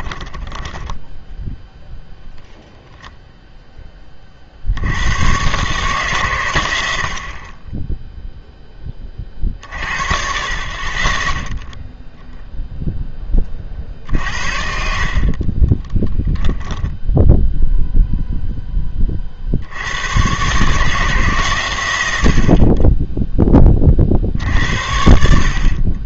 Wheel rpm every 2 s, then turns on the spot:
10, 10, 70, 100, 20, 40, 0, 60, 0, 10, 150, 40, 80.
0-2 14-16